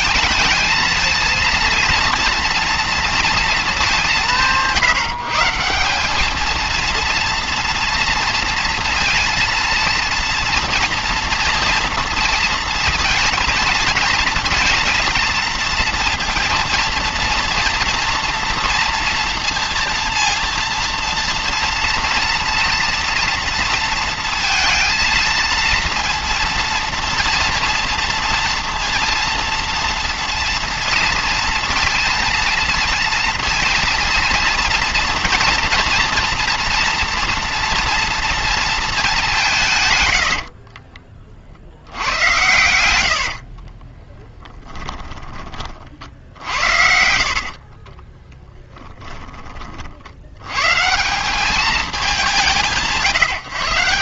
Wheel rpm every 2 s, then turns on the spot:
220, 230, 160, 220, 230, 240, 230, 230, 230, 230, 230, 230, 230, 230, 230, 230, 230, 230, 230, 230, 60, 100, 10, 60, 20, 120, 160.
40-42 44-50